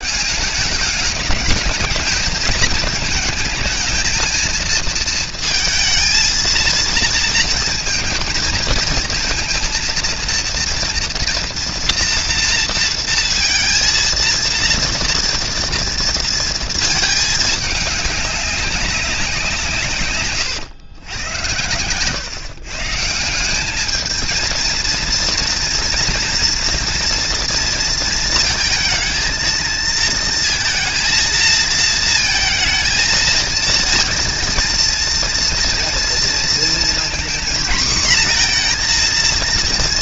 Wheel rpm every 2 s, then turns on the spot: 200, 220, 220, 230, 220, 230, 230, 230, 230, 200, 110, 140, 230, 240, 220, 230, 230, 230, 230, 240.
none